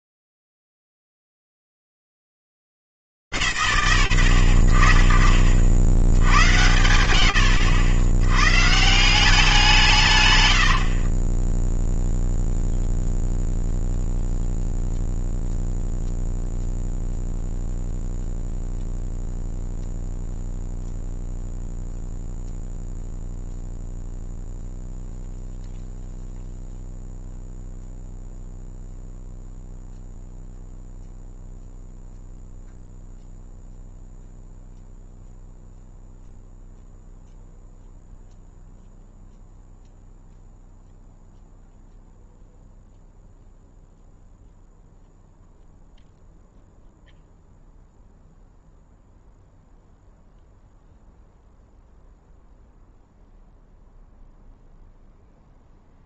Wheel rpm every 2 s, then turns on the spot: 70, 160, 120, 70, 90, 150, 0, 0, 0, 0, 0, 0, 0, 0, 0, 0, 0, 0, 0, 0, 0, 0, 0, 0, 0, 0, 0, 0.
none